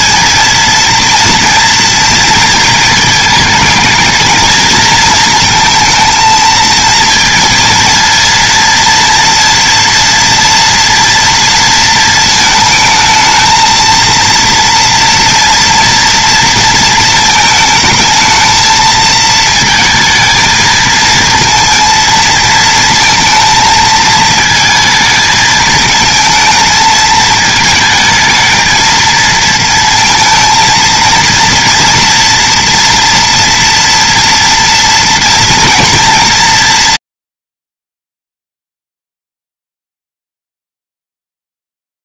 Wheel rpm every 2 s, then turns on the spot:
230, 220, 220, 230, 230, 230, 220, 230, 220, 220, 230, 220, 220, 220, 230, 230, 240, 230, 150, 0, 0.
none